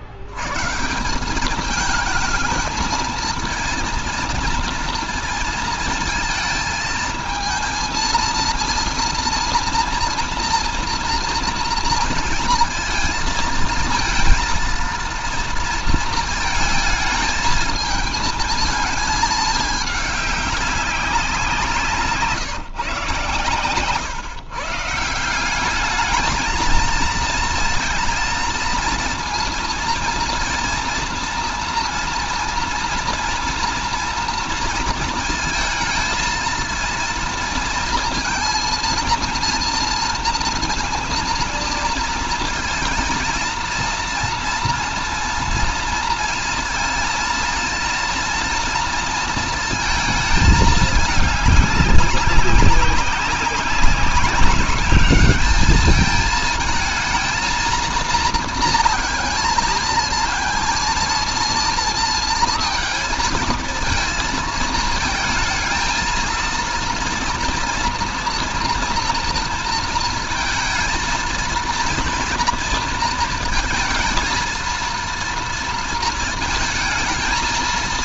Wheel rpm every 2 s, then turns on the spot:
110, 220, 230, 220, 220, 230, 220, 230, 220, 220, 200, 150, 130, 220, 230, 230, 230, 230, 230, 230, 230, 230, 230, 230, 230, 220, 200, 200, 220, 230, 230, 220, 220, 230, 230, 230, 240, 230, 230.
none